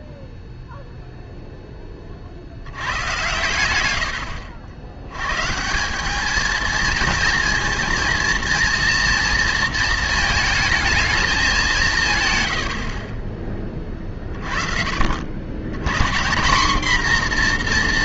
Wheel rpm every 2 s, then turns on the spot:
0, 90, 80, 230, 230, 220, 60, 40, 220.
none